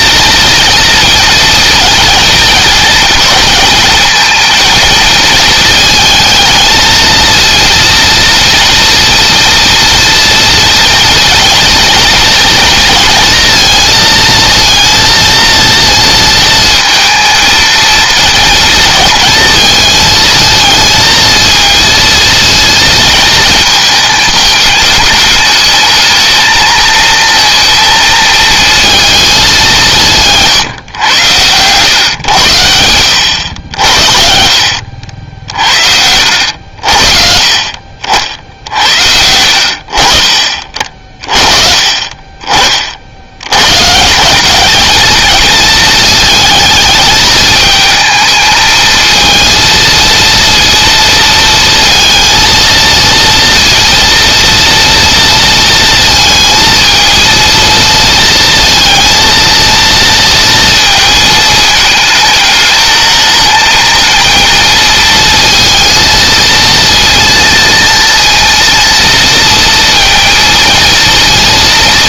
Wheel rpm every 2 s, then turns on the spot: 230, 230, 230, 220, 230, 230, 230, 230, 230, 230, 220, 230, 210, 220, 220, 130, 100, 70, 80, 70, 40, 40, 210, 220, 220, 230, 230, 230, 220, 230, 230, 210, 230, 230, 230, 230.
none